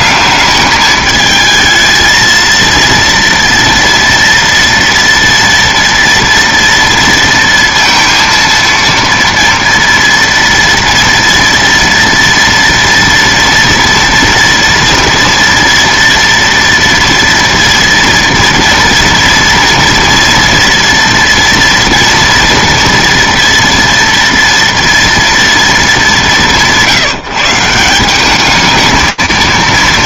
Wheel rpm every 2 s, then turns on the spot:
210, 230, 230, 230, 230, 230, 230, 230, 230, 230, 230, 230, 230, 180, 210.
none